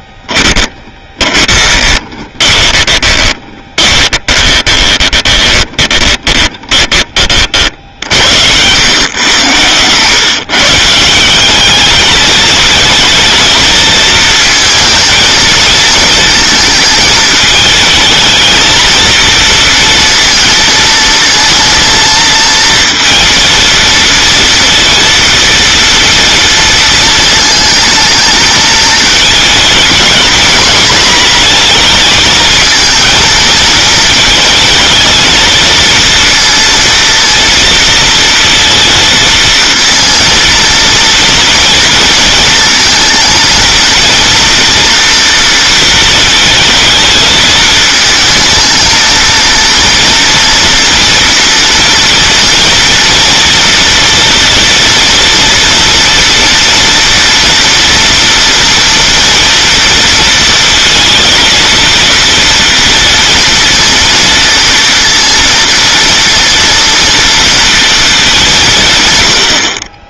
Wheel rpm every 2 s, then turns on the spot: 30, 20, 20, 20, 110, 160, 220, 230, 220, 230, 230, 230, 230, 230, 220, 240, 230, 230, 230, 230, 230, 230, 240, 220, 230, 230, 230, 230, 230, 230, 230, 230, 240, 230, 160.
0-8